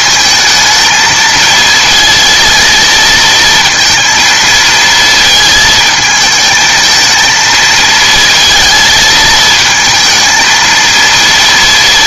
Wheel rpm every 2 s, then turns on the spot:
220, 230, 220, 220, 230, 230.
none